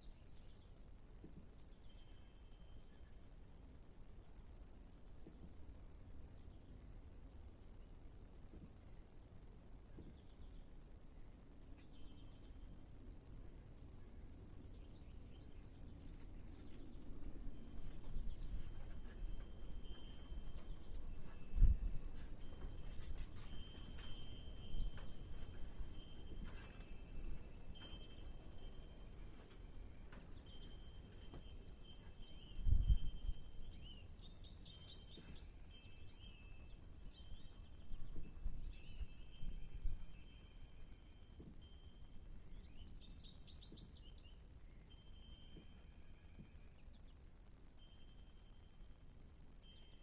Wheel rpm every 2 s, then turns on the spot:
0, 0, 0, 0, 0, 0, 0, 0, 0, 0, 0, 0, 0, 0, 0, 0, 0, 0, 0, 0, 0, 0, 0, 0, 0.
none